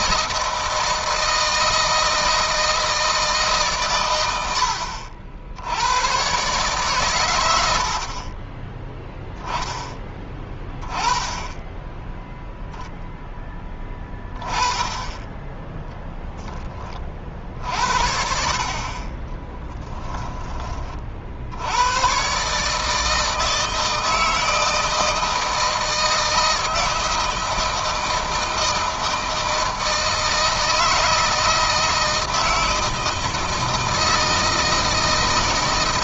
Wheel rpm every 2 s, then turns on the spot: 160, 160, 80, 130, 10, 20, 0, 10, 20, 30, 30, 150, 160, 160, 160, 160, 160, 160.
none